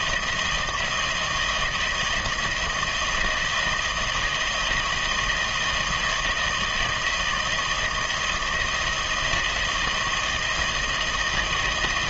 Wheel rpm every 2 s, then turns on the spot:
170, 160, 160, 160, 170, 160.
none